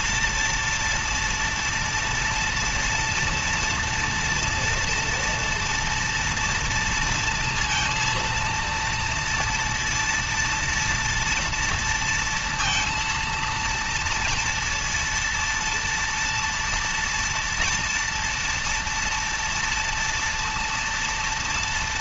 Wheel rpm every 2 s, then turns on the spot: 230, 230, 230, 230, 230, 230, 230, 230, 230, 230, 230.
none